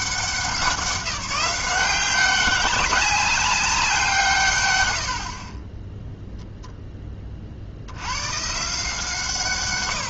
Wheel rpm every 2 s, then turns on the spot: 190, 200, 110, 10, 160.
none